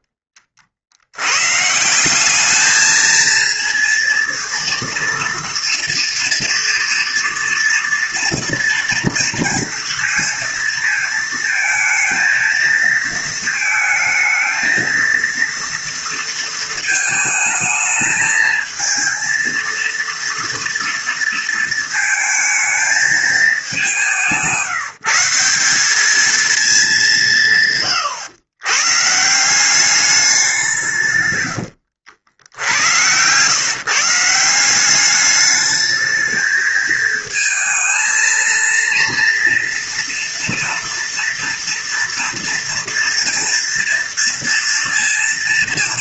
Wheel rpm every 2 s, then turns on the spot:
40, 210, 230, 230, 230, 230, 230, 220, 220, 220, 230, 220, 160, 210, 130, 170, 90, 190, 220, 230, 230, 230, 230.
none